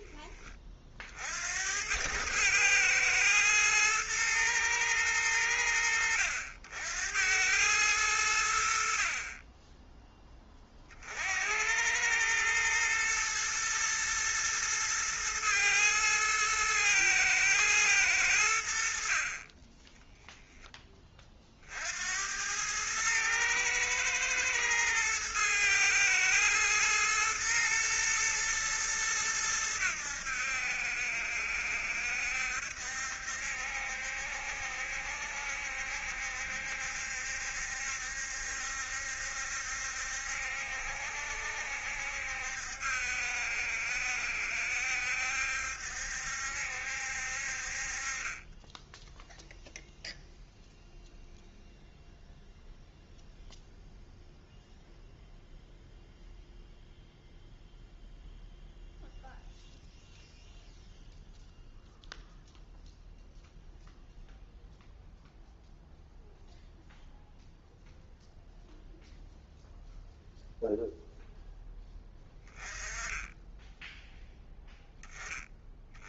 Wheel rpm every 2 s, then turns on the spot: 40, 110, 110, 80, 50, 40, 110, 110, 110, 80, 20, 110, 110, 110, 110, 70, 70, 70, 70, 70, 70, 70, 70, 70, 10, 0, 0, 0, 0, 0, 0, 0, 0, 0, 0, 0, 20, 0.
none